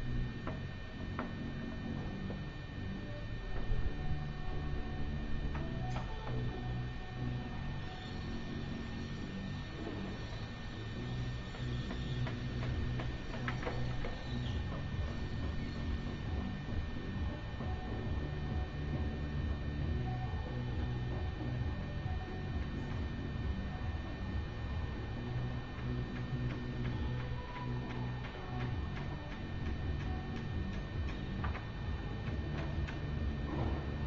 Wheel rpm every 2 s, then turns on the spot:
0, 0, 0, 0, 0, 0, 0, 0, 0, 0, 0, 0, 0, 0, 0, 0, 0.
none